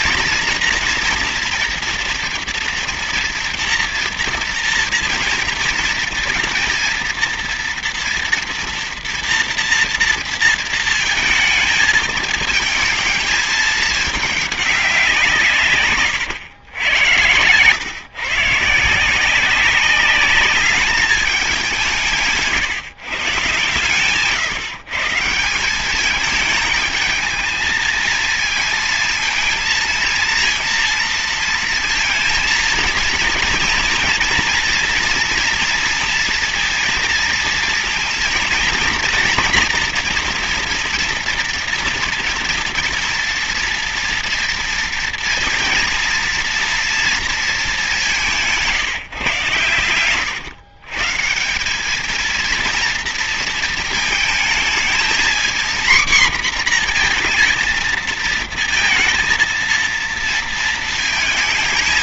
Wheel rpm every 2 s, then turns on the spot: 230, 230, 230, 230, 230, 230, 220, 200, 100, 140, 200, 160, 120, 210, 220, 230, 230, 230, 230, 230, 230, 230, 230, 230, 160, 130, 230, 220, 240, 220, 230.
none